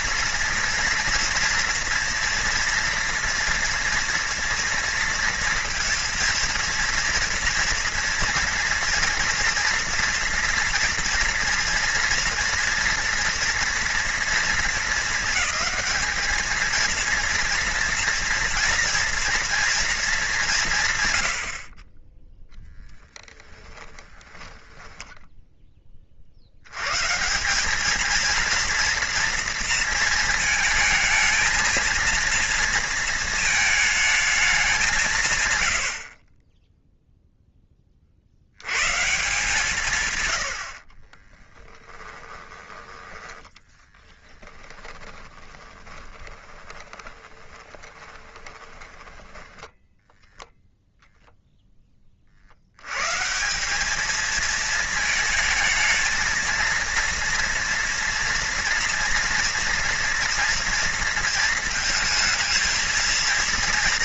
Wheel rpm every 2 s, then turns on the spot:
230, 240, 240, 230, 230, 240, 230, 220, 230, 230, 130, 10, 10, 110, 230, 220, 230, 190, 10, 120, 40, 10, 10, 20, 20, 0, 100, 220, 230, 230, 230, 230.
22-26 40-42 44-50